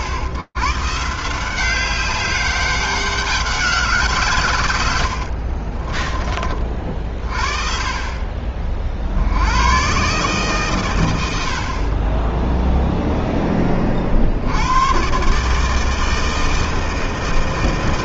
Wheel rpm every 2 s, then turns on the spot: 110, 200, 120, 30, 20, 140, 0, 70, 160.
none